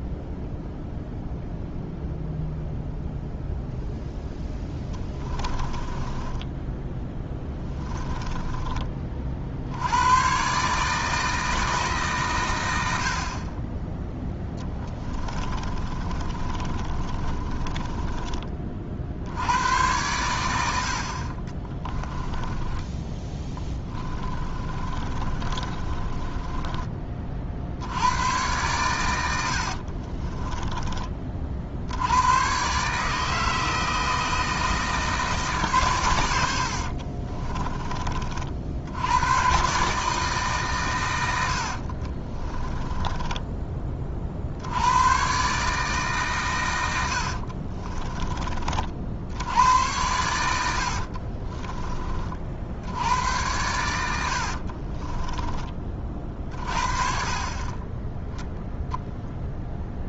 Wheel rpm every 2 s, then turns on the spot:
0, 0, 10, 10, 30, 150, 90, 20, 30, 50, 70, 20, 30, 20, 110, 20, 140, 160, 50, 80, 120, 20, 90, 100, 50, 70, 80, 40, 40, 0.
4-8 14-18 22-26 36-38 42-44 50-52 54-56